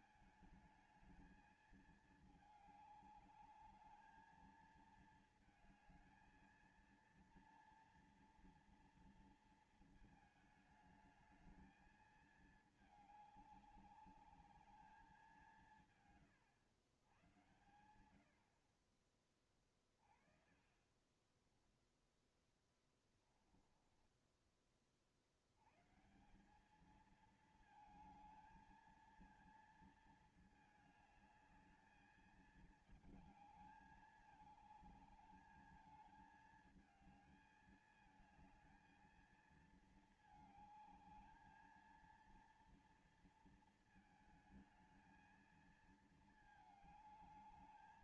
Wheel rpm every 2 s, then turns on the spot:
220, 210, 220, 230, 230, 220, 220, 210, 130, 70, 30, 10, 20, 170, 220, 220, 220, 210, 220, 220, 220, 230, 220, 220.
20-26